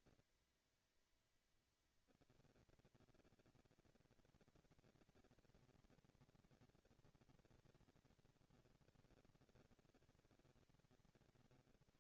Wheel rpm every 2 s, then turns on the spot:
230, 230, 230, 220, 210, 190.
none